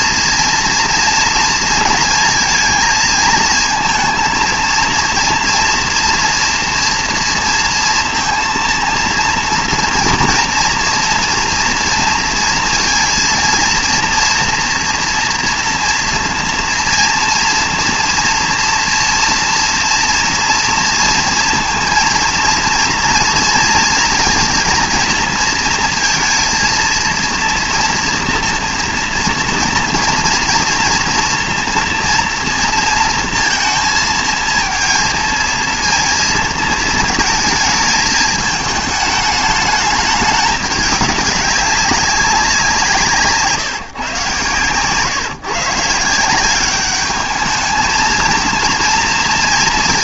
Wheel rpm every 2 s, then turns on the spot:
230, 230, 230, 230, 230, 230, 230, 230, 230, 230, 230, 230, 230, 220, 230, 230, 230, 230, 220, 220, 200, 180, 120, 190, 230.
none